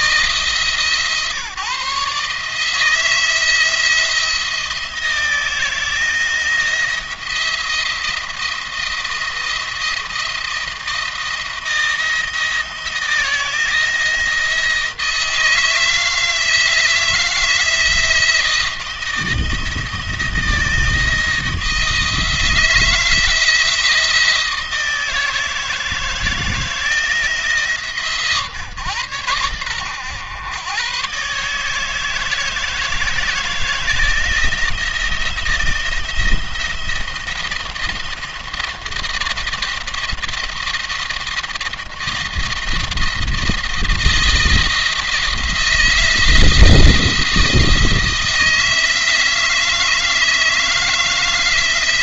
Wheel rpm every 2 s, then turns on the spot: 140, 160, 170, 170, 170, 160, 160, 160, 160, 170, 160, 160, 160, 170, 130, 120, 160, 170, 170, 170, 170, 170, 160, 170, 170, 160.
none